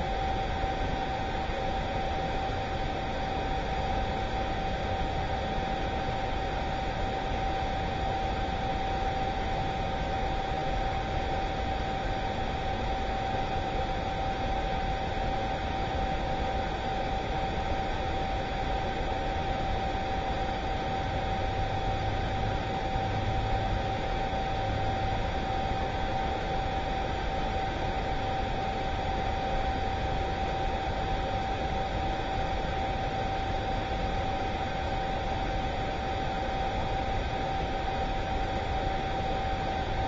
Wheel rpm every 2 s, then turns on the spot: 0, 0, 0, 0, 0, 0, 0, 0, 0, 0, 0, 0, 0, 0, 0, 0, 0, 0, 0, 0.
none